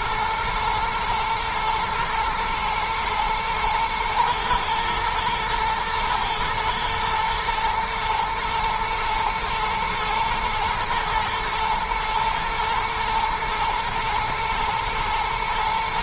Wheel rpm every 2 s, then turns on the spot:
110, 110, 120, 110, 110, 110, 110, 110.
none